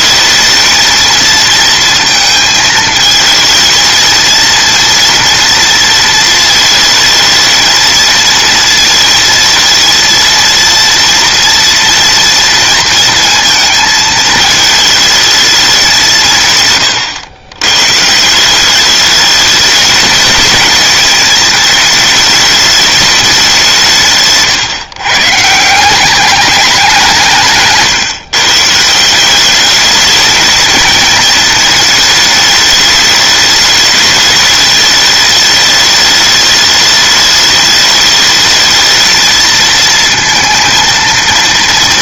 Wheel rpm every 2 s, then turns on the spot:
220, 230, 220, 230, 230, 230, 230, 220, 180, 140, 210, 220, 160, 190, 140, 210, 220, 210, 210, 210, 230.
none